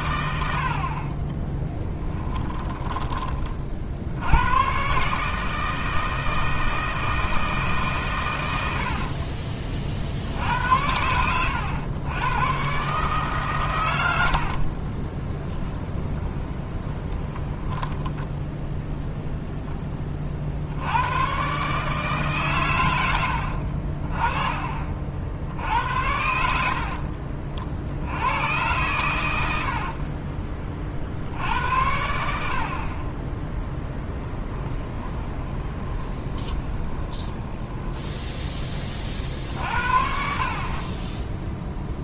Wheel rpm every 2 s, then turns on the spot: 70, 10, 110, 160, 90, 80, 120, 50, 20, 0, 60, 120, 30, 60, 100, 40, 40, 10, 20, 20, 40.
2-4 14-18 26-28 34-38